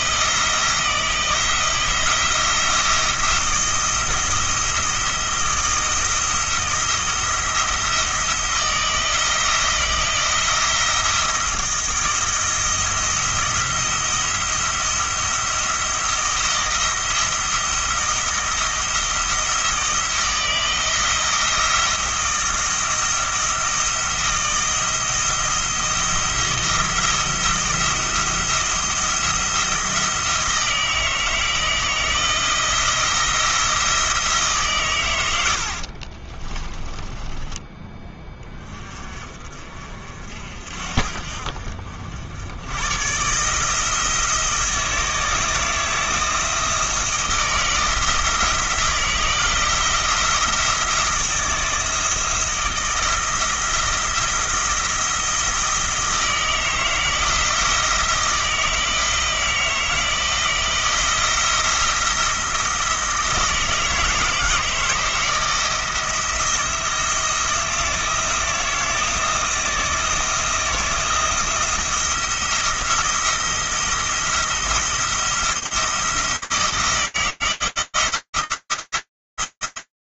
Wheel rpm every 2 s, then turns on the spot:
160, 170, 160, 160, 170, 170, 170, 170, 170, 170, 160, 170, 170, 170, 170, 160, 170, 130, 20, 30, 50, 120, 160, 170, 170, 170, 160, 170, 160, 160, 170, 160, 160, 160, 170, 170, 170, 170, 160, 170.
36-38